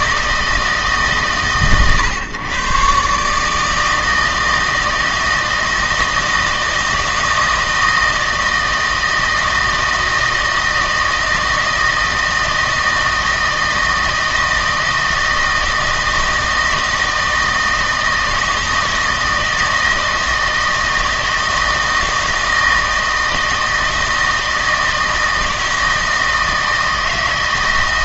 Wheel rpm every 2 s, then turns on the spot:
150, 130, 160, 160, 160, 160, 160, 160, 160, 160, 160, 160, 160, 160.
none